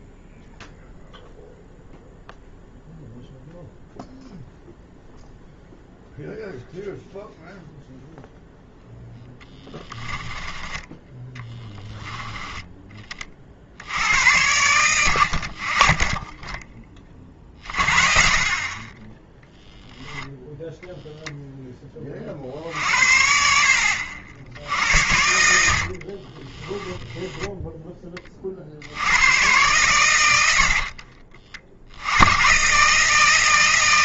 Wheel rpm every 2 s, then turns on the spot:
0, 0, 0, 0, 0, 10, 20, 90, 30, 20, 0, 50, 80, 10, 80, 50, 140.
18-20 26-28 30-32